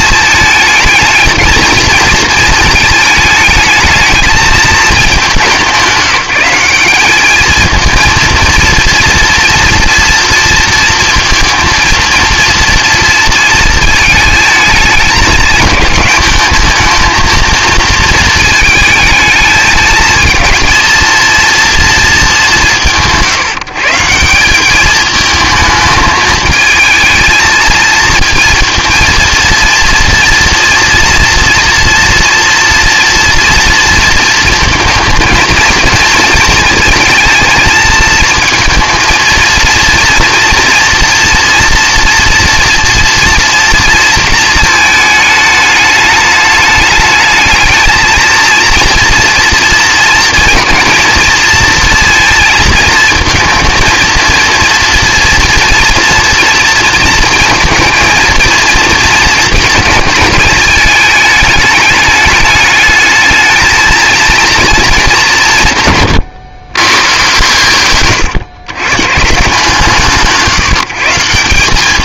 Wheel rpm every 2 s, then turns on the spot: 220, 220, 220, 200, 230, 230, 230, 220, 220, 220, 230, 180, 200, 220, 230, 240, 230, 230, 230, 230, 230, 230, 220, 210, 230, 230, 230, 230, 230, 230, 220, 210, 220, 120, 120, 170.
none